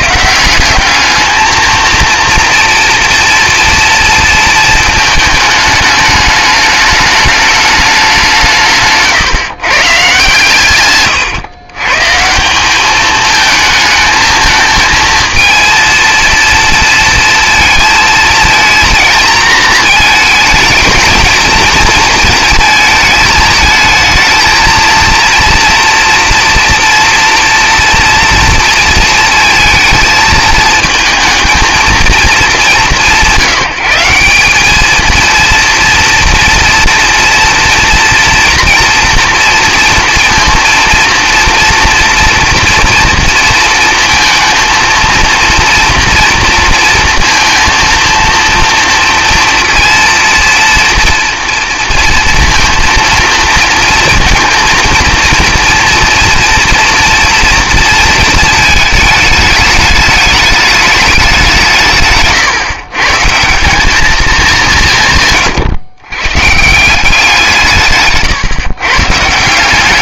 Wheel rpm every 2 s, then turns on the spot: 190, 230, 230, 210, 170, 140, 180, 220, 230, 230, 220, 220, 220, 230, 230, 220, 210, 200, 230, 230, 230, 230, 230, 230, 230, 230, 230, 230, 230, 220, 210, 140, 190, 150, 130.
10-12